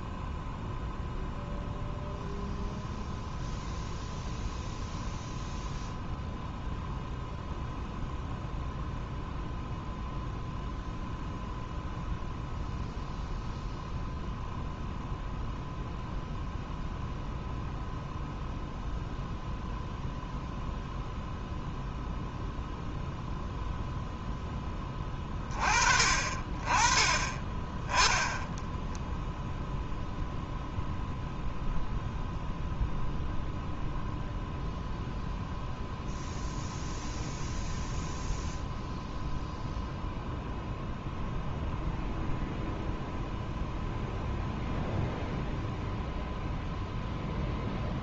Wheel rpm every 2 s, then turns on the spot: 0, 0, 0, 0, 0, 0, 0, 0, 0, 0, 0, 0, 20, 20, 10, 0, 0, 0, 0, 0, 0, 0, 0, 0.
none